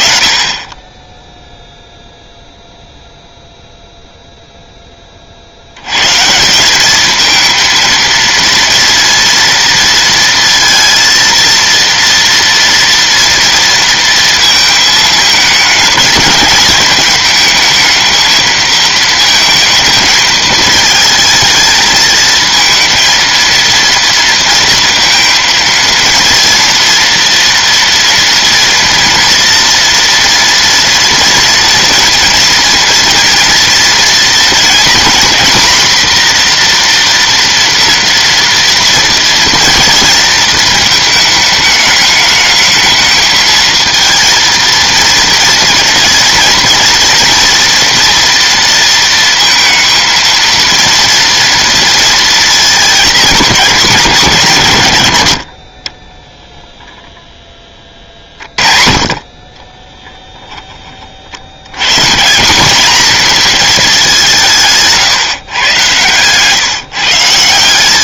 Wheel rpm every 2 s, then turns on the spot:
40, 0, 20, 210, 230, 230, 240, 220, 210, 220, 220, 230, 230, 230, 230, 230, 230, 240, 240, 230, 220, 220, 230, 230, 230, 230, 220, 120, 0, 40, 10, 190, 160, 130.
none